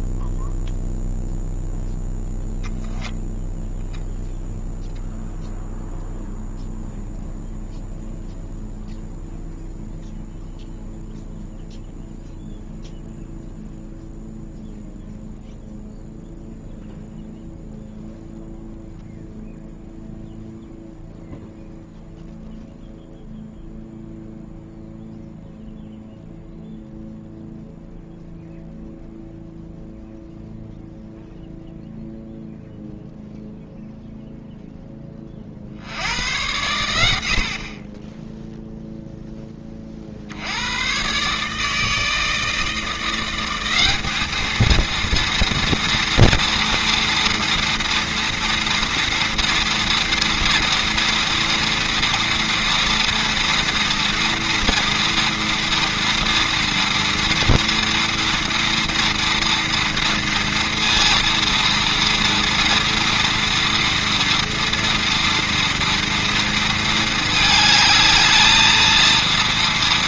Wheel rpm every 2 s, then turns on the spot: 0, 0, 0, 0, 0, 0, 0, 0, 0, 0, 0, 0, 0, 0, 0, 0, 0, 10, 90, 0, 120, 160, 220, 230, 230, 240, 240, 240, 230, 230, 230, 230, 230, 220, 220.
none